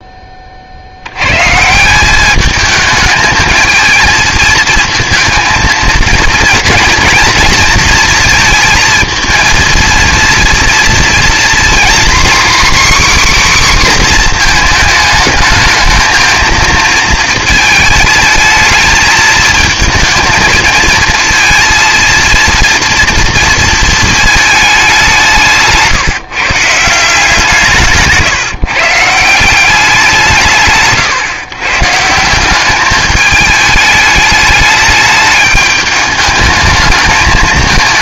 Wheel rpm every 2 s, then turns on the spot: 60, 210, 220, 230, 230, 230, 270, 230, 220, 220, 220, 230, 210, 190, 160, 110, 190, 210, 220.
none